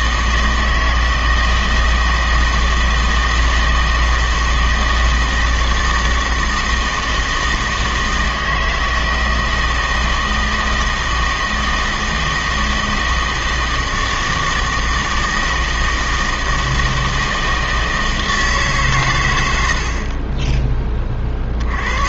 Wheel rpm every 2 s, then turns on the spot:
160, 160, 160, 160, 160, 160, 160, 160, 160, 140, 20.
none